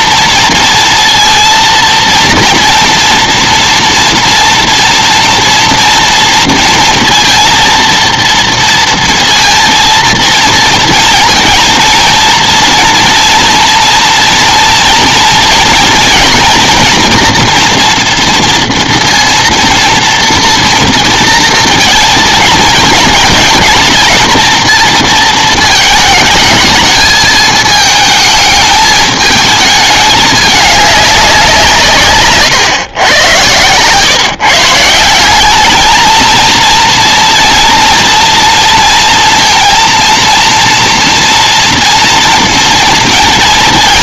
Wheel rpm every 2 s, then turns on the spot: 240, 230, 230, 230, 230, 230, 230, 240, 230, 230, 230, 230, 220, 220, 220, 210, 140, 140, 220, 230, 230, 230.
none